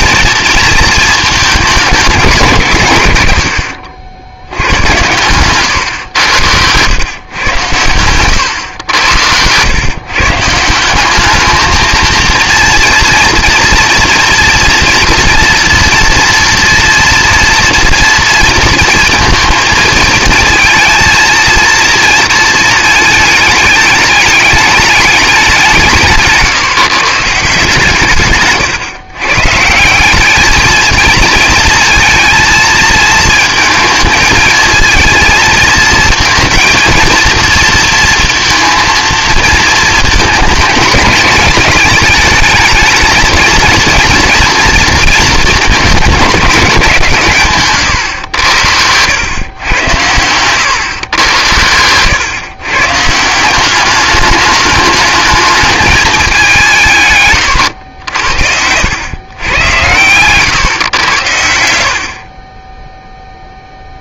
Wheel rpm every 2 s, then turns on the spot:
230, 140, 90, 100, 110, 160, 230, 240, 230, 230, 230, 230, 210, 160, 120, 220, 220, 220, 230, 230, 210, 210, 230, 200, 90, 120, 140, 210, 160, 80, 120, 20.
8-10